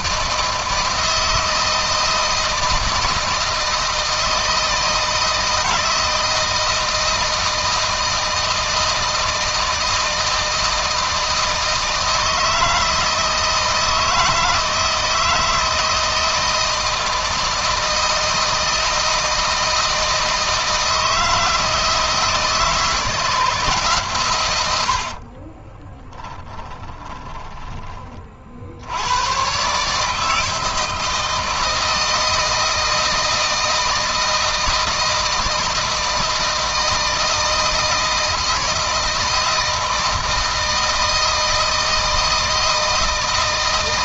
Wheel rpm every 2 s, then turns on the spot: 160, 160, 160, 160, 160, 160, 160, 160, 160, 160, 160, 160, 100, 20, 80, 160, 160, 160, 160, 160, 160, 160.
26-28